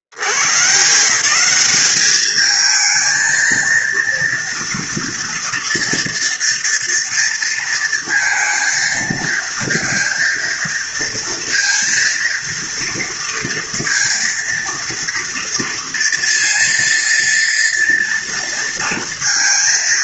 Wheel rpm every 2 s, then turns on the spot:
50, 210, 230, 230, 230, 230, 230, 230, 230, 230.
none